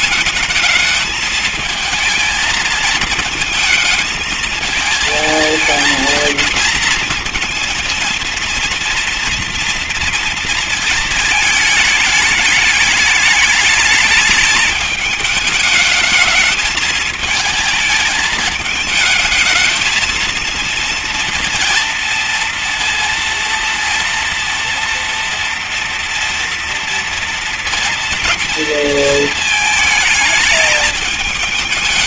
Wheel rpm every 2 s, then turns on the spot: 220, 220, 220, 230, 230, 230, 210, 220, 220, 220, 230, 230, 230, 230, 230, 220.
none